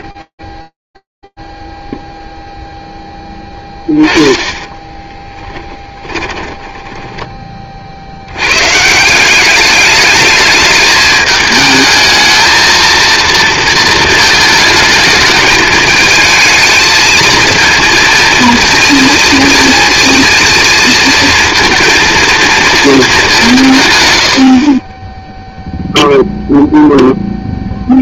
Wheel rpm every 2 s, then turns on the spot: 50, 0, 10, 20, 130, 210, 220, 220, 220, 230, 230, 230, 50, 0.
4-8